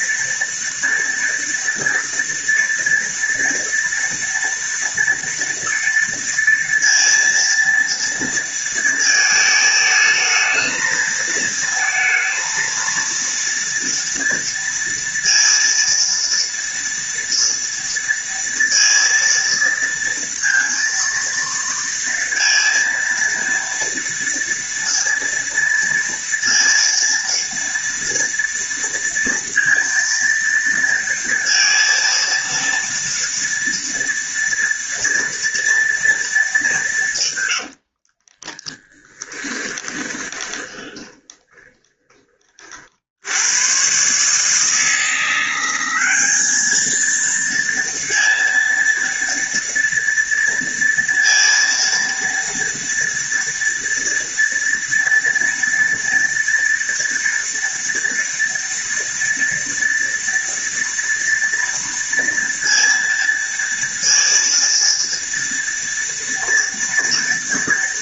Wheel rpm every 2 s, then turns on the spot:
240, 230, 230, 230, 230, 220, 230, 230, 230, 230, 230, 230, 230, 230, 230, 230, 230, 230, 190, 10, 20, 40, 160, 210, 230, 230, 230, 230, 230, 240, 230, 230, 230, 230.
38-42